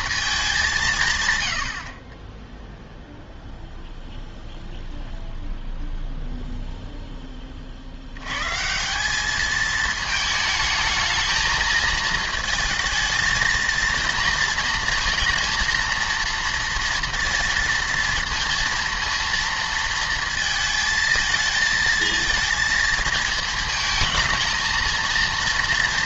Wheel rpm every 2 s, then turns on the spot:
190, 0, 0, 0, 160, 220, 220, 230, 230, 230, 220, 230, 230.
none